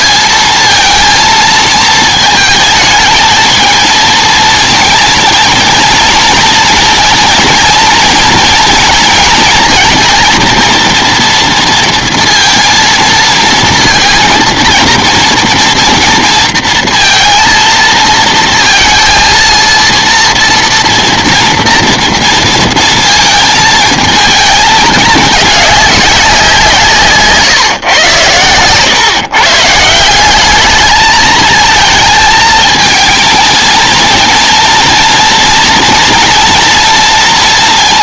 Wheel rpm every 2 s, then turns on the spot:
220, 220, 230, 230, 230, 230, 230, 230, 230, 230, 230, 230, 210, 170, 120, 210, 220, 230, 230.
none